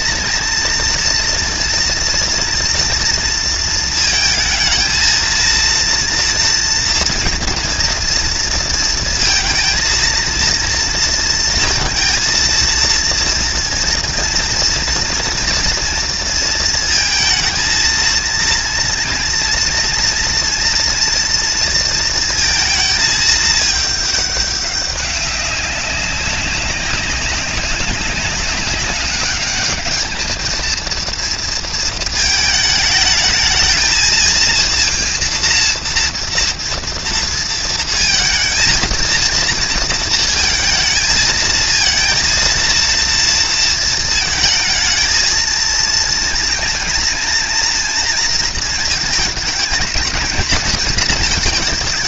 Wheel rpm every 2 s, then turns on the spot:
230, 230, 220, 230, 230, 230, 230, 230, 230, 230, 230, 220, 200, 200, 200, 230, 220, 230, 230, 230, 230, 230, 220, 230, 220, 220.
none